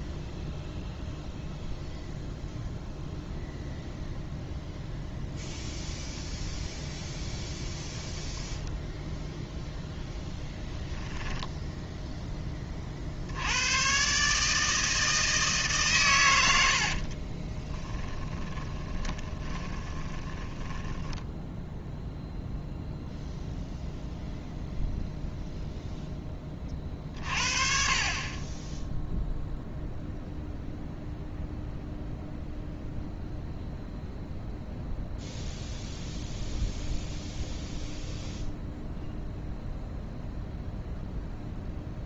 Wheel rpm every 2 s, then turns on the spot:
0, 0, 0, 0, 0, 10, 40, 160, 70, 20, 10, 0, 0, 40, 10, 0, 0, 0, 0, 0, 0.
10-12 16-22